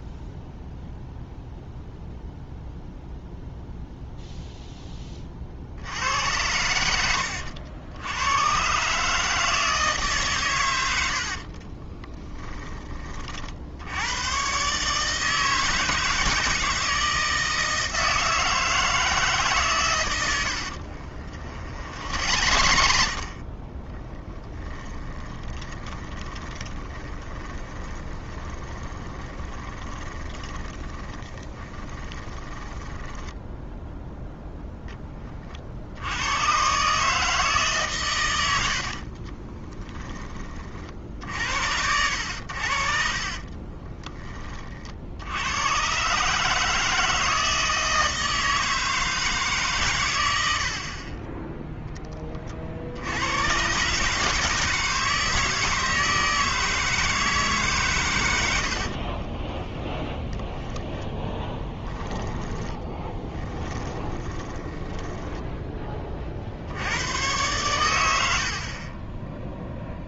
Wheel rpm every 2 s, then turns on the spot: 0, 0, 10, 80, 140, 90, 20, 140, 160, 160, 70, 60, 10, 20, 20, 20, 10, 10, 140, 70, 50, 60, 40, 160, 160, 60, 60, 160, 160, 80, 10, 10, 10, 80, 30.
20-34 38-40 58-66